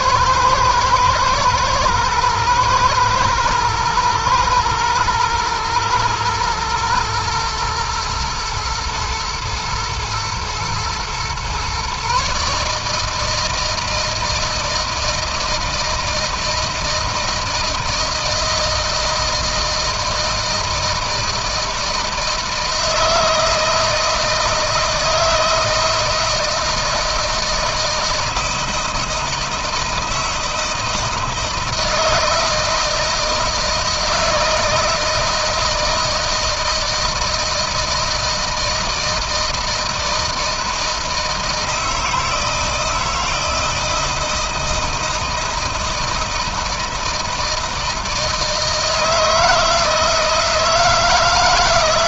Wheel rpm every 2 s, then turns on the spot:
110, 120, 120, 120, 110, 120, 150, 160, 160, 160, 160, 160, 160, 160, 160, 160, 160, 160, 160, 160, 160, 160, 160, 160, 160, 160.
none